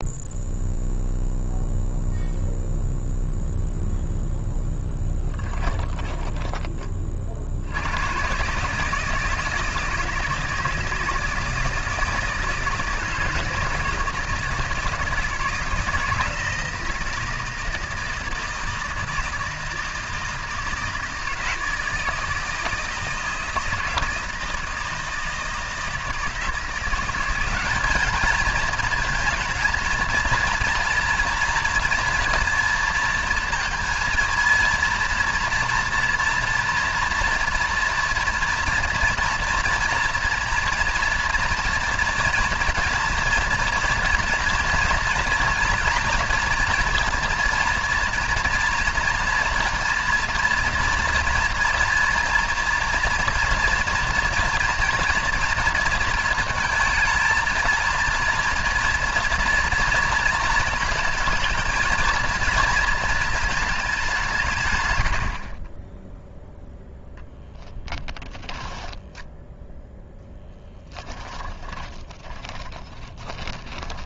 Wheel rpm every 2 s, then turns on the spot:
0, 0, 10, 20, 150, 160, 160, 160, 160, 160, 170, 160, 160, 170, 230, 230, 230, 230, 230, 230, 230, 230, 230, 230, 230, 230, 230, 230, 220, 230, 230, 230, 110, 0, 10, 10, 20.
4-6 68-74